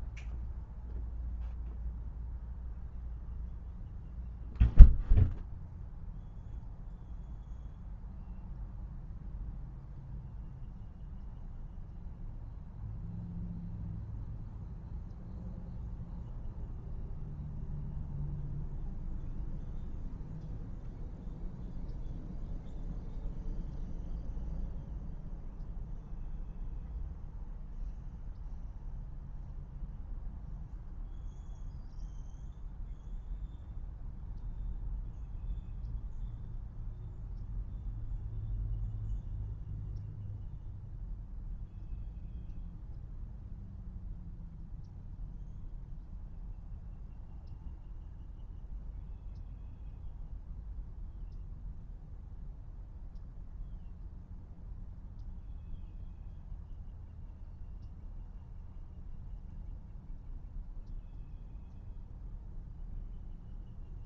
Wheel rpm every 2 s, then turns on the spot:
0, 0, 0, 0, 0, 0, 0, 0, 0, 0, 0, 0, 0, 0, 0, 0, 0, 0, 0, 0, 0, 0, 0, 0, 0, 0, 0, 0, 0, 0, 0, 0.
none